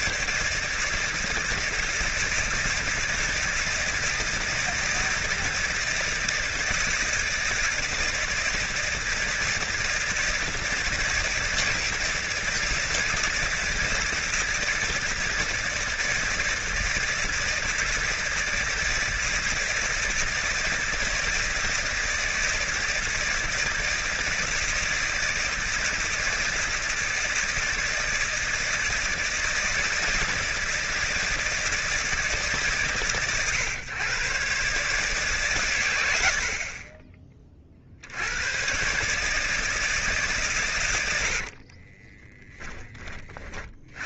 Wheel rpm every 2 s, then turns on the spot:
150, 160, 170, 160, 160, 160, 160, 160, 160, 160, 160, 160, 160, 160, 160, 160, 150, 130, 60, 110, 130, 10.
none